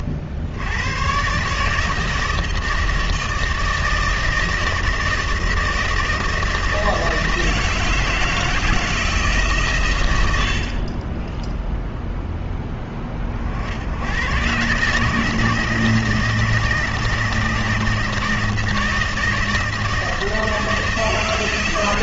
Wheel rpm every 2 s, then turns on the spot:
90, 160, 160, 160, 160, 70, 10, 130, 160, 160, 160.
10-12